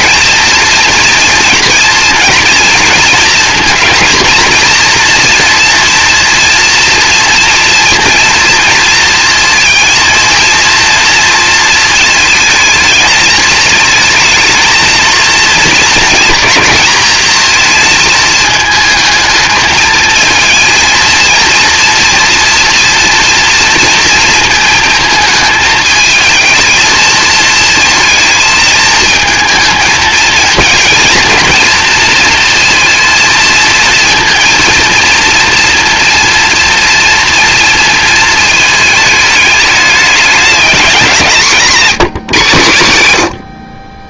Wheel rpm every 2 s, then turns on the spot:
230, 230, 230, 230, 230, 230, 220, 220, 220, 220, 220, 230, 220, 220, 220, 230, 230, 230, 230, 220, 190, 140.
none